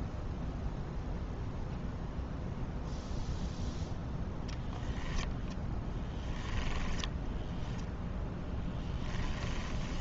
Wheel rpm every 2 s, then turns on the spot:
0, 0, 0, 10, 10.
6-10